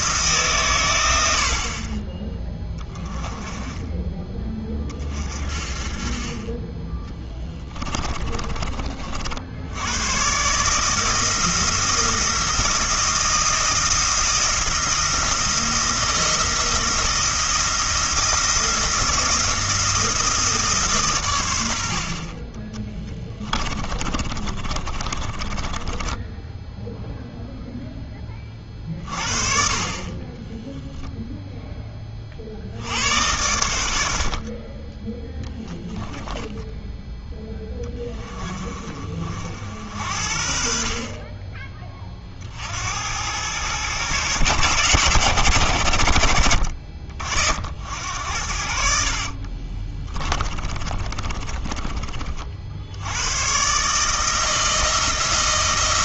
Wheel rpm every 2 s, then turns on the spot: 120, 10, 20, 20, 30, 150, 170, 170, 160, 170, 150, 20, 30, 0, 40, 10, 70, 30, 10, 30, 50, 70, 110, 50, 60, 30, 60, 160.
22-26 30-32 36-38 50-52